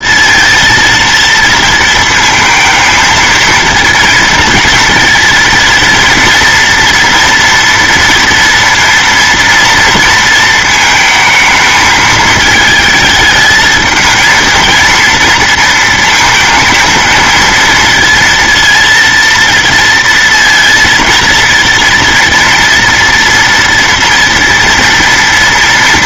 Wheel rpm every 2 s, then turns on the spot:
230, 220, 220, 230, 230, 230, 220, 230, 230, 230, 230, 230, 230.
none